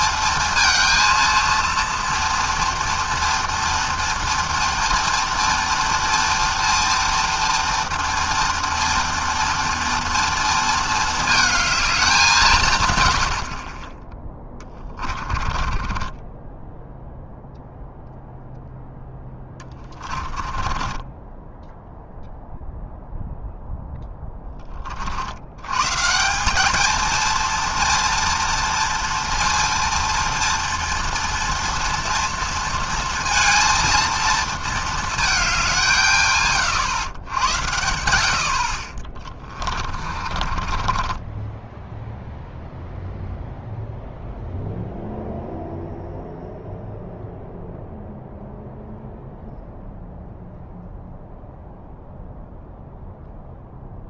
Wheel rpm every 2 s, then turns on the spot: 220, 230, 230, 240, 230, 230, 170, 10, 10, 0, 20, 0, 10, 190, 230, 230, 230, 230, 120, 60, 30, 0, 0, 0, 0, 0, 0.
14-18 20-22 40-42